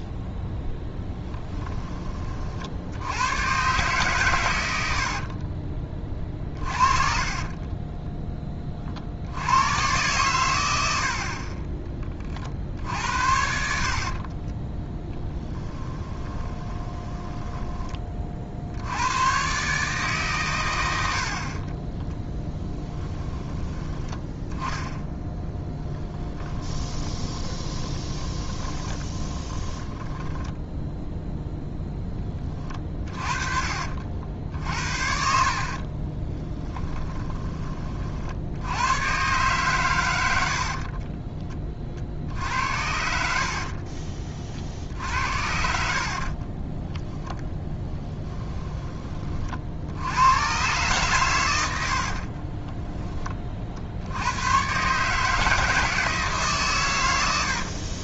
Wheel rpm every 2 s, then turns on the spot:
0, 60, 80, 40, 40, 80, 60, 20, 20, 70, 90, 10, 10, 20, 20, 10, 30, 50, 20, 110, 50, 70, 50, 10, 20, 120, 10, 130, 120.
6-8 12-18 22-24 26-30 32-34 36-38 40-44 46-48 52-54